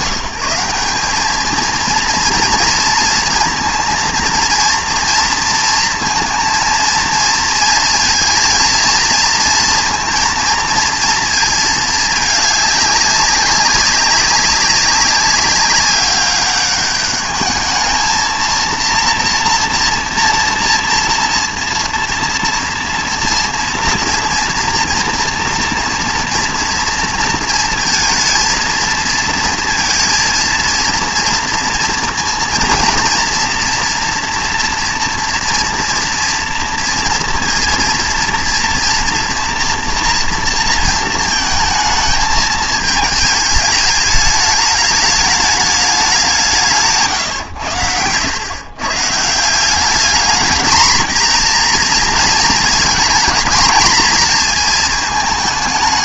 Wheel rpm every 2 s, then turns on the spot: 200, 230, 230, 230, 230, 230, 200, 200, 200, 230, 230, 230, 230, 230, 230, 230, 230, 240, 230, 230, 230, 210, 210, 150, 130, 230, 220, 230.
46-48